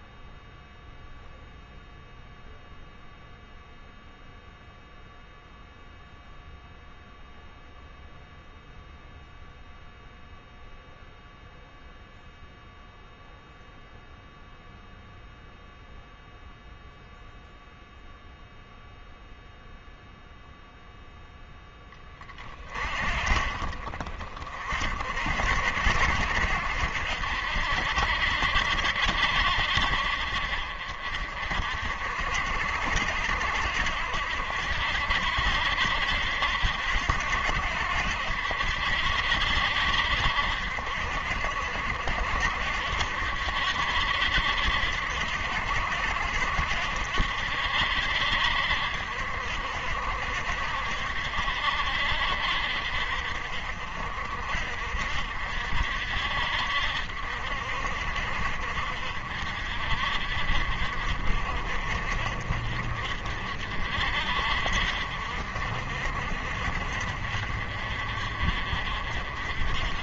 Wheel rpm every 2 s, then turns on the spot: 0, 0, 0, 0, 0, 0, 0, 0, 0, 0, 0, 40, 40, 70, 60, 50, 70, 60, 70, 70, 60, 60, 70, 70, 60, 60, 50, 50, 60, 50, 50, 50, 50, 50, 50.
none